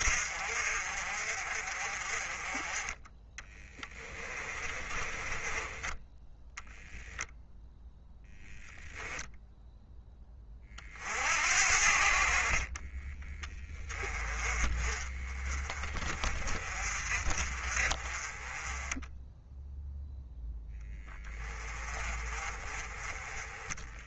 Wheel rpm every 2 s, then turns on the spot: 50, 20, 30, 0, 0, 40, 40, 30, 40, 20, 10, 30.
4-6